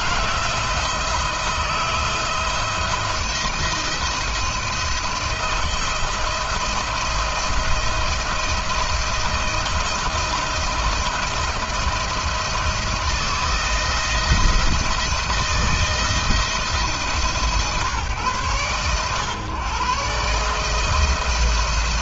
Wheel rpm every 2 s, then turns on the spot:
170, 170, 170, 170, 170, 170, 170, 160, 160, 130, 160.
none